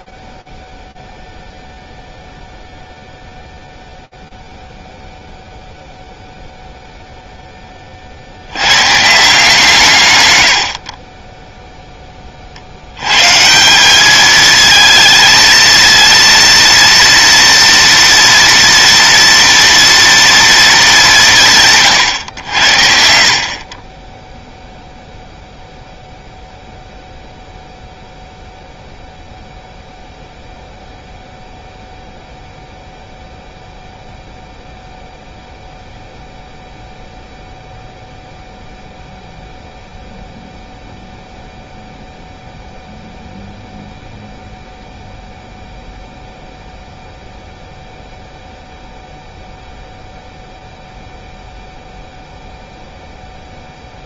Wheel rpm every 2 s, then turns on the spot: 10, 0, 0, 10, 160, 0, 160, 230, 230, 230, 160, 40, 0, 0, 0, 0, 0, 0, 0, 0, 0, 0, 0, 0, 0, 0, 0.
none